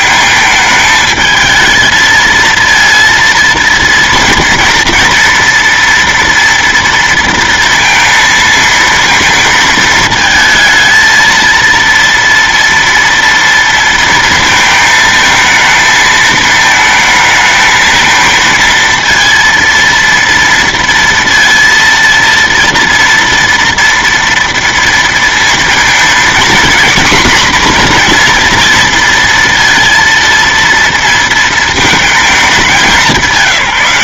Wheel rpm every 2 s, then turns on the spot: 220, 220, 230, 230, 230, 220, 230, 220, 220, 220, 230, 230, 230, 230, 240, 230, 210.
none